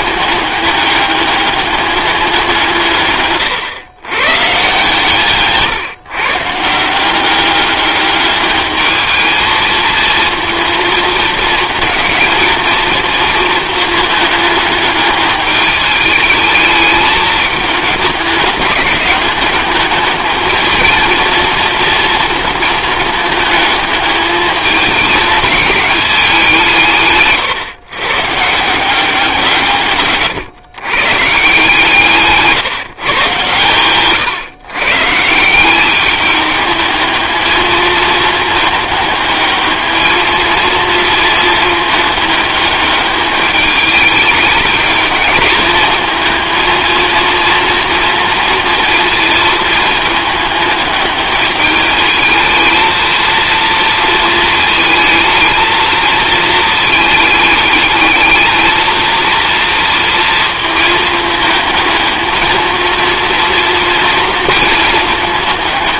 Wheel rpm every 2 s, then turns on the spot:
200, 150, 140, 170, 210, 220, 230, 210, 220, 200, 220, 220, 210, 160, 170, 120, 150, 140, 210, 210, 230, 210, 210, 220, 230, 210, 230, 220, 220, 220, 220, 230, 230.
none